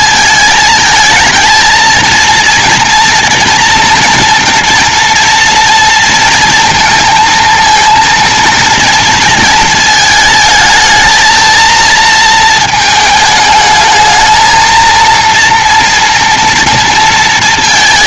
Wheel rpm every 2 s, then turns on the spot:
210, 230, 230, 230, 230, 220, 220, 230, 230.
none